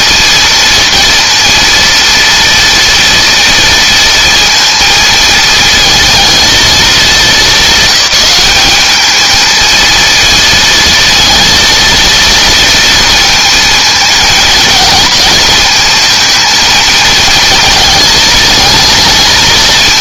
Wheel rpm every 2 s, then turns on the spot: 230, 230, 230, 200, 210, 230, 230, 220, 220, 220.
none